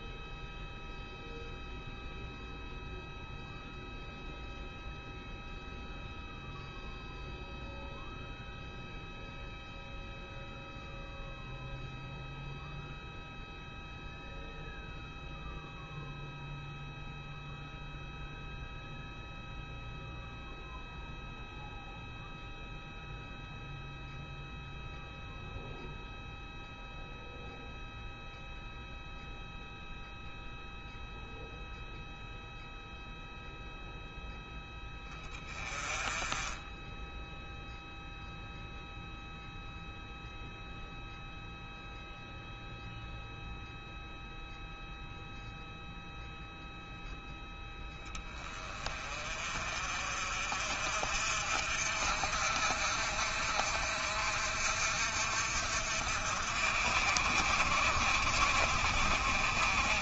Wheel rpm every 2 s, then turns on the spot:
0, 0, 0, 0, 0, 0, 0, 0, 0, 0, 0, 0, 0, 0, 0, 0, 0, 10, 10, 0, 0, 0, 0, 0, 20, 50, 50, 50, 50, 50.
none